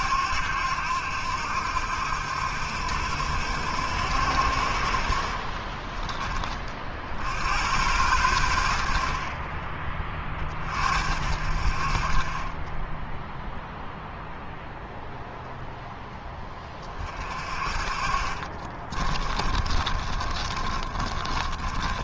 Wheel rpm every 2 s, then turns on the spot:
80, 80, 50, 50, 60, 50, 10, 10, 30, 30, 30.
12-14 18-22